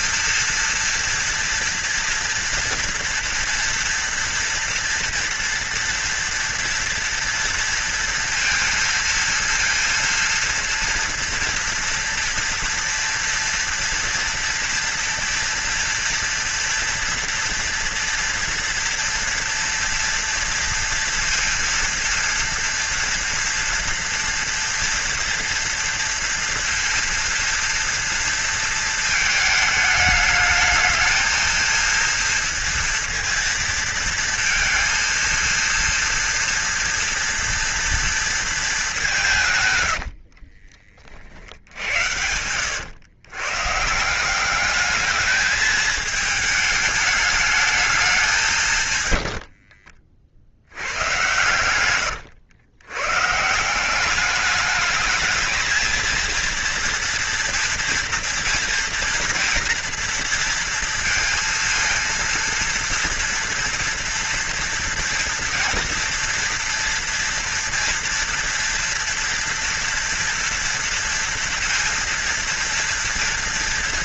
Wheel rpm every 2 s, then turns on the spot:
230, 230, 240, 230, 230, 230, 230, 230, 230, 230, 230, 230, 240, 230, 230, 210, 230, 230, 230, 230, 60, 90, 190, 220, 170, 60, 90, 200, 230, 230, 230, 230, 230, 240, 240, 240, 230.
40-44